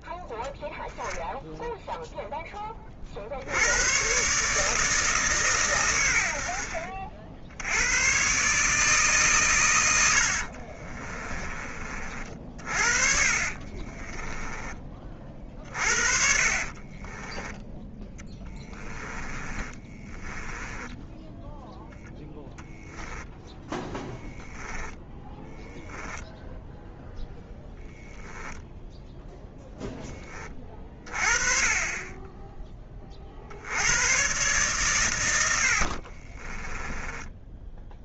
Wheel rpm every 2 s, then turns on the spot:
0, 40, 160, 60, 150, 50, 40, 30, 30, 10, 10, 0, 10, 0, 0, 30, 20, 130, 20.
10-14 16-22 36-38